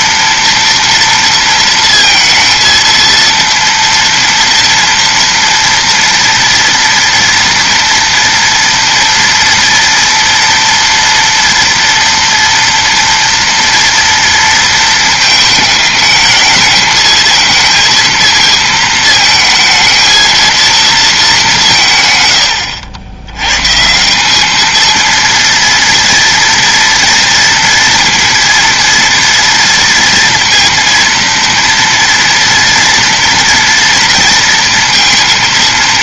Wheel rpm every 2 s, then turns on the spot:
230, 230, 240, 240, 230, 230, 230, 220, 220, 220, 210, 80, 230, 230, 230, 230, 230, 230.
none